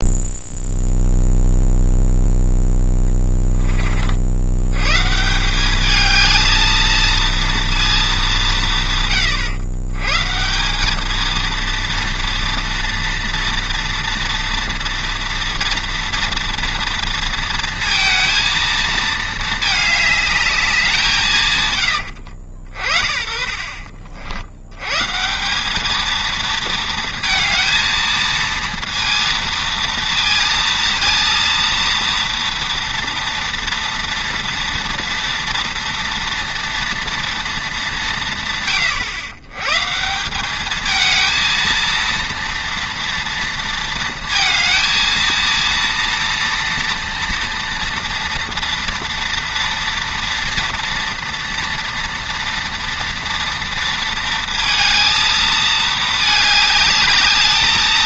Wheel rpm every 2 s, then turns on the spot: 0, 10, 100, 220, 170, 170, 230, 230, 230, 230, 200, 60, 90, 230, 230, 230, 230, 230, 230, 130, 200, 230, 220, 230, 230, 230, 230, 230, 210.
2-4